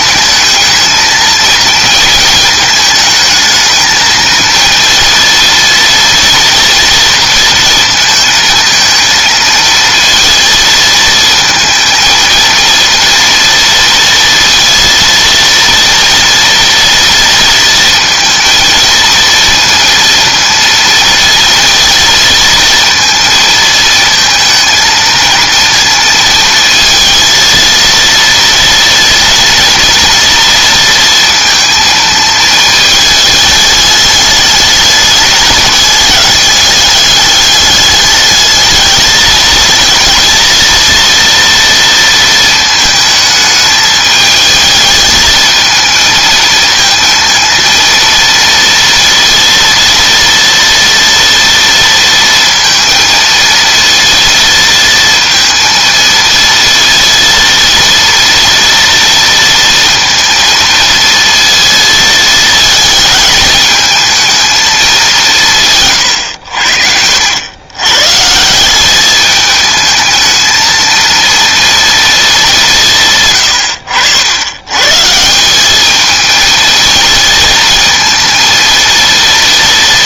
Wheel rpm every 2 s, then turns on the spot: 220, 220, 230, 230, 220, 230, 230, 230, 230, 230, 230, 230, 230, 230, 240, 230, 220, 210, 210, 220, 230, 220, 220, 220, 230, 230, 230, 230, 230, 240, 230, 220, 220, 80, 190, 220, 180, 120, 220, 230.
66-68